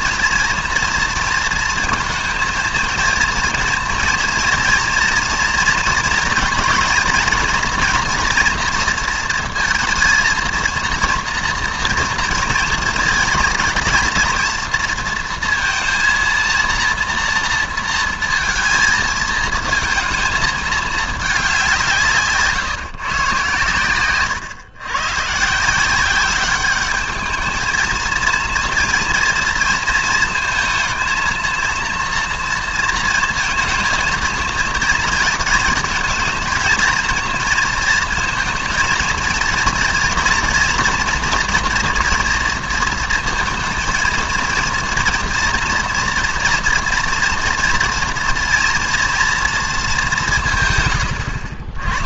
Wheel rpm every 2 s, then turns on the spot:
230, 230, 230, 230, 230, 230, 230, 230, 230, 220, 220, 140, 120, 200, 230, 230, 230, 230, 220, 220, 240, 230, 230, 230, 230, 140.
none